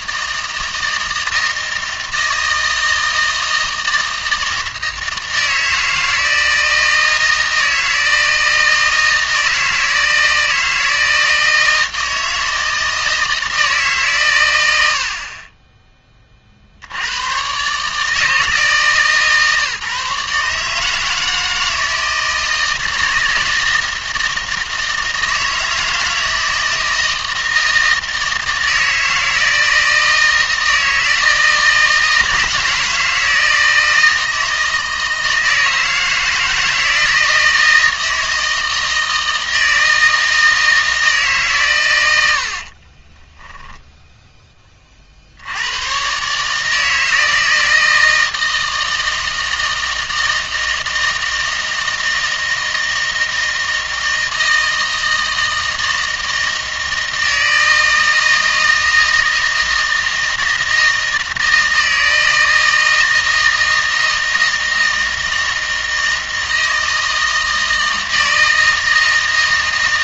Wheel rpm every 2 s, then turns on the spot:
160, 160, 160, 160, 160, 160, 160, 90, 50, 160, 150, 160, 160, 160, 160, 160, 160, 160, 160, 160, 160, 50, 20, 150, 160, 160, 160, 160, 160, 160, 160, 160, 160, 160, 160.
42-44